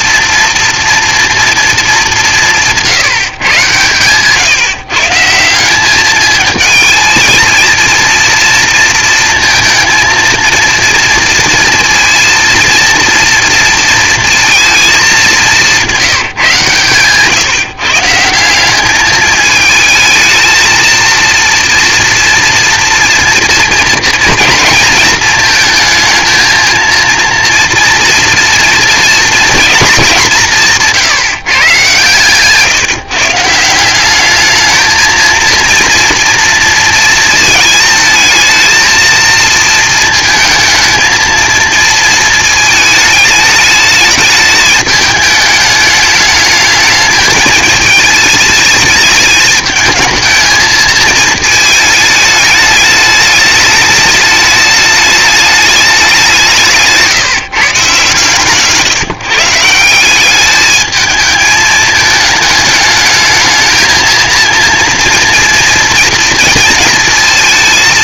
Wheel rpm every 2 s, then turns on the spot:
230, 160, 150, 220, 230, 230, 230, 220, 140, 200, 230, 230, 220, 230, 230, 160, 150, 220, 230, 220, 220, 220, 210, 210, 210, 220, 210, 210, 150, 140, 210, 210, 230, 230.
none